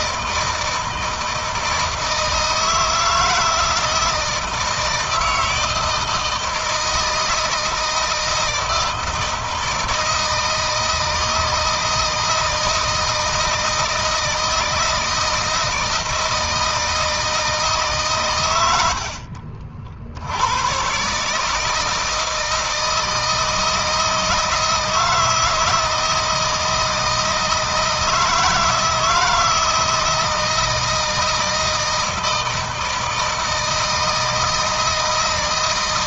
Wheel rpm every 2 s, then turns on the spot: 160, 160, 160, 160, 160, 160, 160, 160, 160, 80, 120, 160, 160, 160, 160, 160, 160, 160.
none